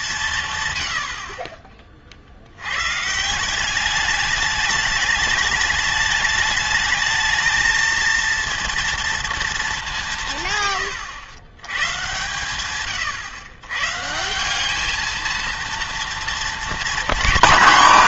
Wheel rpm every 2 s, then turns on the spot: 120, 100, 210, 210, 230, 110, 110, 200, 240.
none